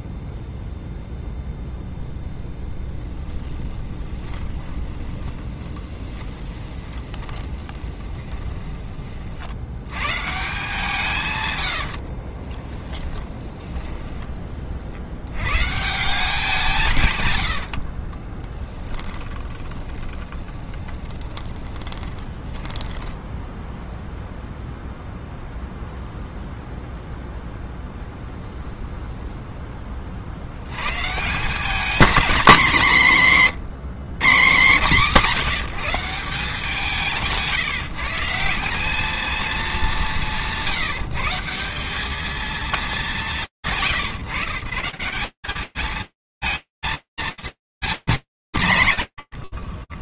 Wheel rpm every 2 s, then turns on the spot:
0, 0, 10, 20, 20, 150, 20, 50, 160, 20, 20, 10, 0, 0, 0, 110, 210, 160, 170, 200, 160, 220, 160, 220, 110.
4-8 12-14 18-24